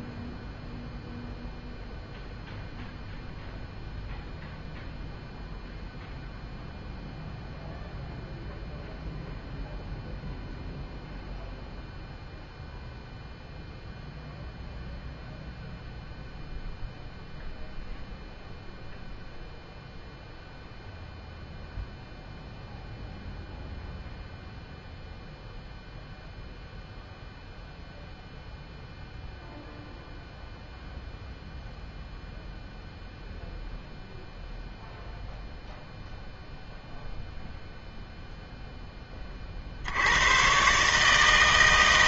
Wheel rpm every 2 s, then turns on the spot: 0, 0, 0, 0, 0, 0, 0, 0, 0, 0, 0, 0, 0, 0, 0, 0, 0, 0, 0, 0, 130.
none